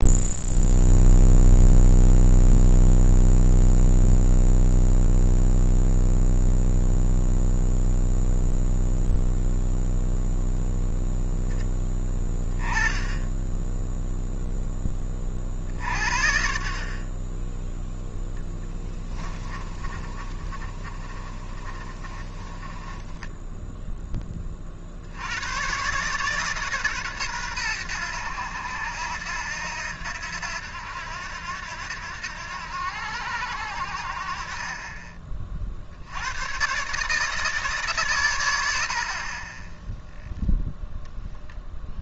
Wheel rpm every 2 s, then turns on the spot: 0, 0, 0, 0, 0, 0, 10, 10, 40, 10, 30, 20, 30, 140, 90, 80, 80, 40, 120, 90, 0.
18-24